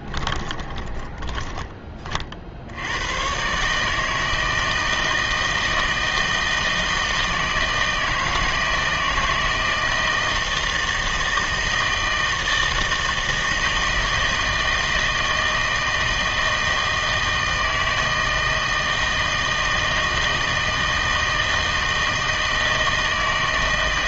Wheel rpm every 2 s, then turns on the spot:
20, 80, 160, 160, 160, 160, 160, 160, 160, 160, 160, 160.
0-2